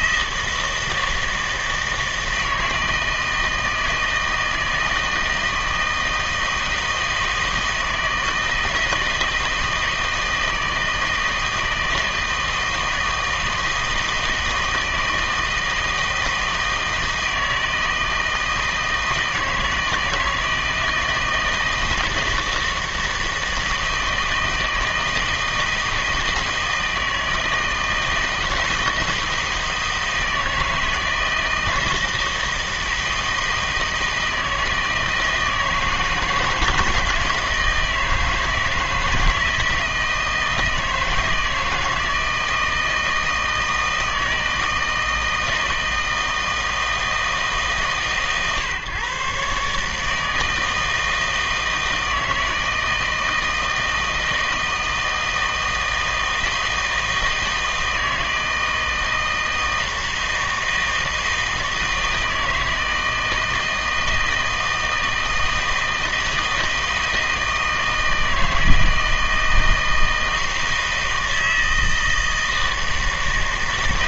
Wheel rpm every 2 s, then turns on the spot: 160, 160, 160, 160, 160, 160, 160, 160, 160, 160, 160, 160, 160, 160, 160, 160, 160, 160, 170, 160, 160, 160, 160, 160, 140, 160, 160, 160, 160, 160, 160, 160, 160, 160, 160, 160, 160.
none